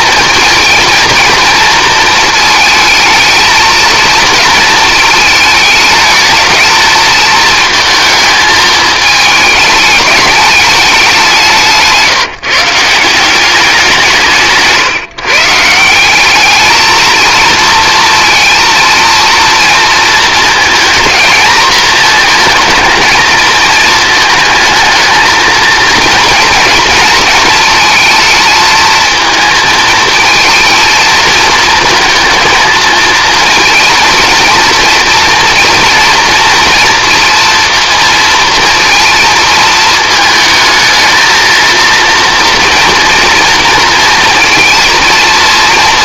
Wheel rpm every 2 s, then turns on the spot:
230, 220, 230, 220, 220, 210, 160, 160, 200, 230, 230, 220, 220, 230, 220, 230, 230, 230, 230, 230, 220, 230, 230.
none